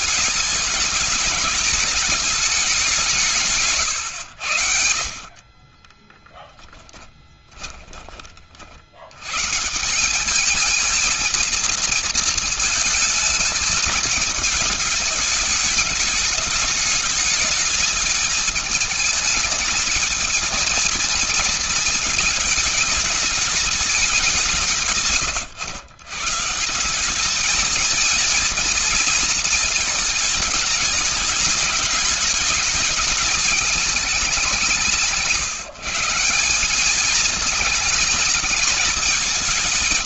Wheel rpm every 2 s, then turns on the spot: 210, 180, 70, 10, 30, 220, 220, 210, 210, 220, 230, 220, 150, 170, 230, 210, 210, 190, 210, 220.
6-8